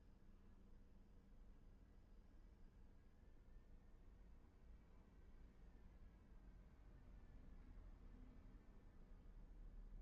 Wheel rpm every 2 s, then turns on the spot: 0, 0, 0, 0, 0.
none